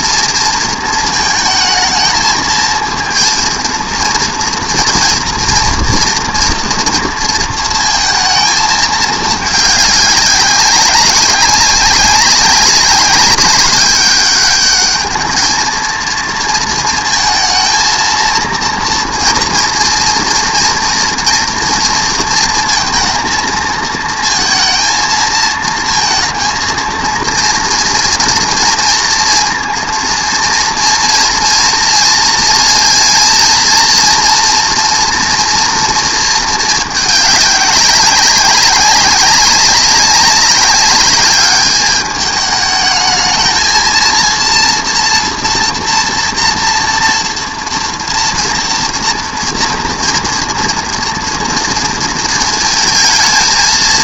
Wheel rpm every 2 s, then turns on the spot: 230, 220, 230, 230, 220, 190, 190, 210, 230, 230, 230, 230, 230, 230, 230, 230, 230, 240, 220, 190, 200, 210, 230, 230, 230, 230, 220.
none